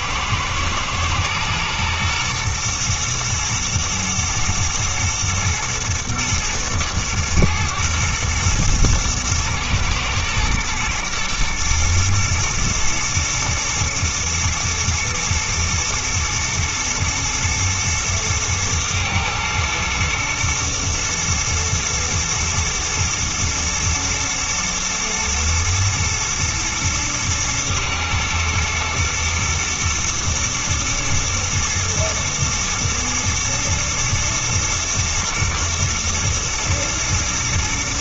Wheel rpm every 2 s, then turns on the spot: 110, 110, 110, 110, 120, 110, 110, 120, 120, 110, 120, 110, 120, 110, 110, 110, 110, 120, 110.
none